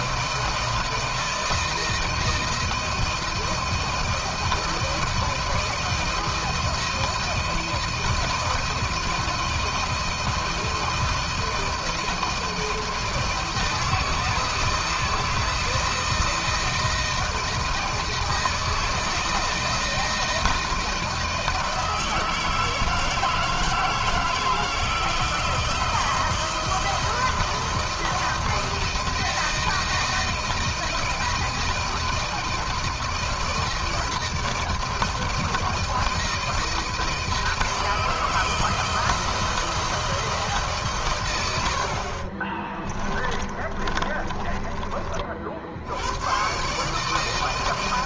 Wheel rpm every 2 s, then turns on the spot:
160, 160, 160, 160, 170, 160, 170, 160, 170, 170, 170, 160, 160, 170, 160, 160, 160, 160, 160, 160, 130, 30, 40, 150.
42-44